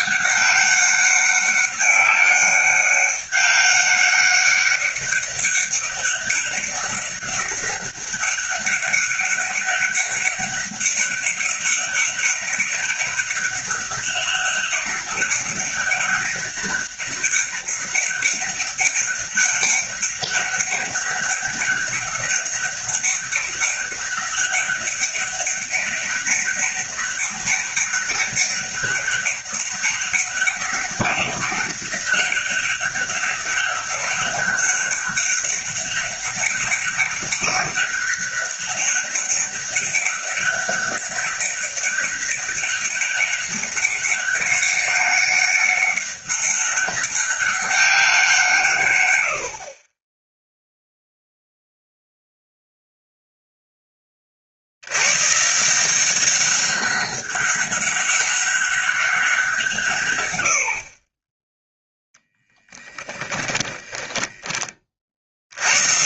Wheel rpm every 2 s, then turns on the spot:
200, 200, 200, 200, 200, 200, 190, 200, 200, 200, 200, 200, 200, 200, 200, 200, 200, 200, 200, 200, 200, 200, 200, 200, 130, 0, 0, 80, 190, 190, 50, 10, 30.
62-64